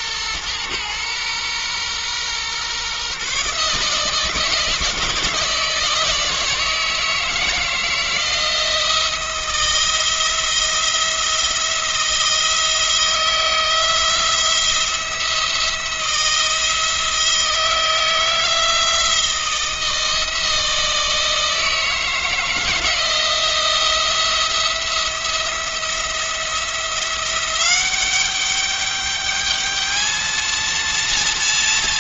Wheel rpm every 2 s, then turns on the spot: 120, 130, 160, 160, 170, 170, 170, 170, 170, 170, 160, 170, 170, 170, 200, 230.
none